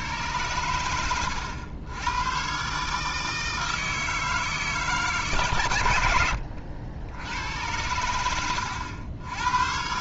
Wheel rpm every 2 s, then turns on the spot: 110, 130, 150, 70, 90.
none